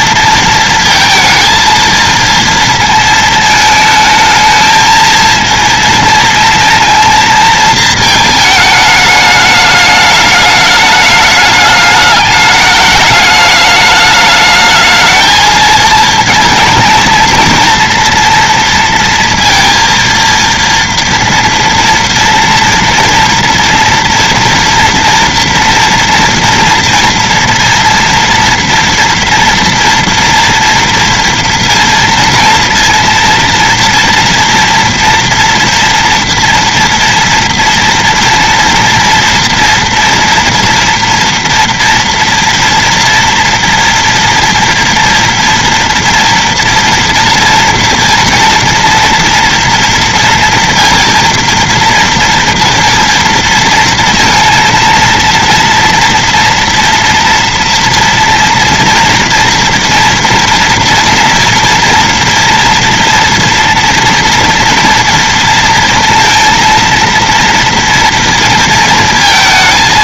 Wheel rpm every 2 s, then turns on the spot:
230, 230, 220, 230, 210, 210, 210, 220, 220, 230, 230, 230, 230, 240, 230, 240, 230, 230, 230, 230, 230, 230, 230, 230, 230, 230, 230, 230, 230, 230, 240, 240, 230, 230, 230.
none